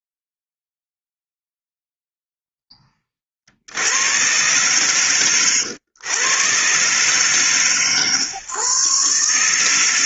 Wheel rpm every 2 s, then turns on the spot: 0, 0, 110, 110, 130.
none